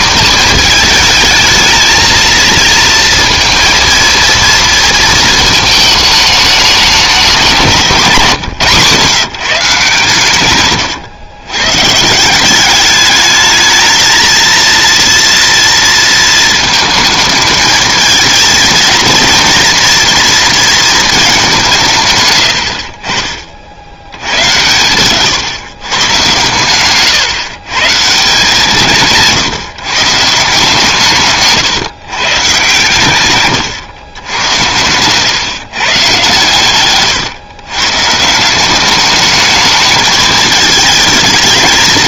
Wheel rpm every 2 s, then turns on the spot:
210, 230, 230, 210, 170, 130, 190, 230, 220, 220, 230, 100, 110, 120, 170, 170, 130, 100, 130, 180, 220.
22-24 34-38